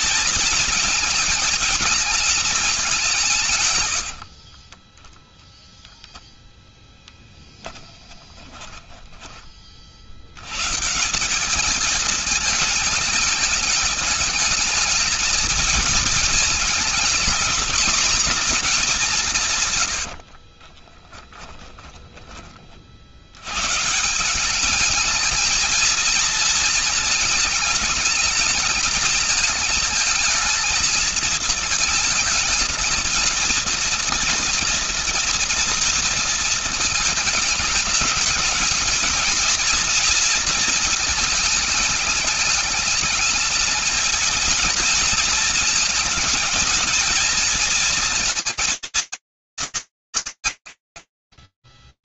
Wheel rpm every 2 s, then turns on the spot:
220, 210, 40, 0, 10, 90, 220, 220, 220, 220, 50, 40, 180, 220, 220, 220, 220, 230, 230, 220, 230, 220, 220, 230, 230, 140.
8-10 20-22